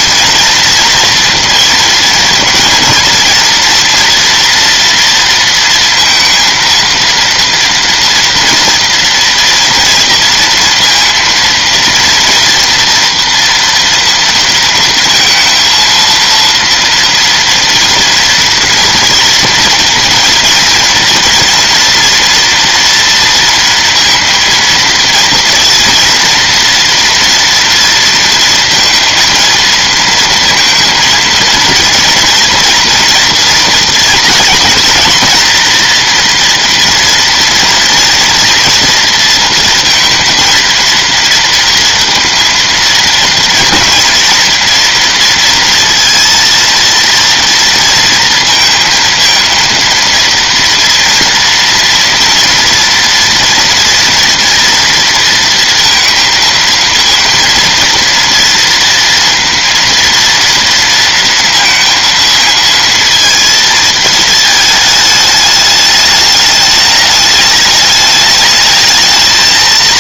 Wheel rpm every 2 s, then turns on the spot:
230, 230, 230, 230, 230, 230, 240, 230, 230, 230, 230, 230, 230, 230, 230, 230, 230, 240, 240, 230, 230, 230, 230, 230, 230, 230, 230, 230, 230, 230, 230, 230, 220, 210, 210.
none